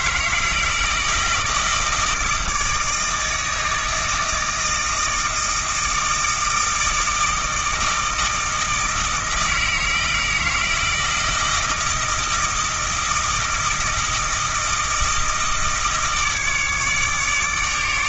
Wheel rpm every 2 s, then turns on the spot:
160, 160, 160, 160, 160, 160, 160, 160, 150.
none